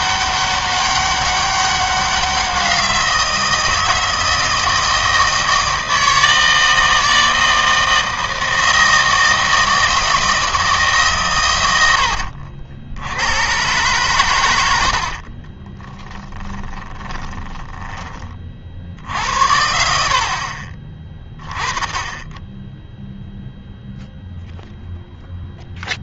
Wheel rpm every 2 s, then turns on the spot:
200, 180, 160, 160, 160, 160, 70, 90, 20, 60, 40, 10, 0.
14-18